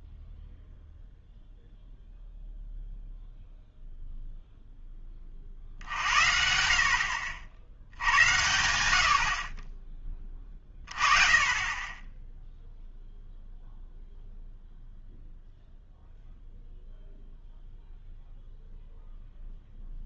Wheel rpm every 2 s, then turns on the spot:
0, 0, 0, 60, 80, 30, 0, 0, 0, 0.
none